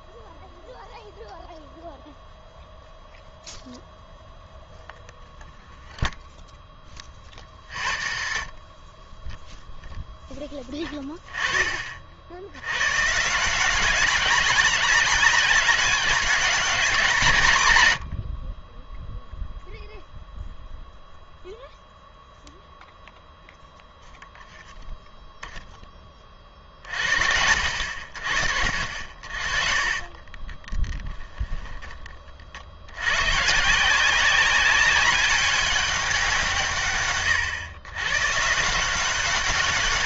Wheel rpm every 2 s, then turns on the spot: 0, 0, 0, 10, 40, 10, 90, 190, 200, 30, 0, 0, 0, 40, 50, 20, 60, 190, 150, 150.
30-32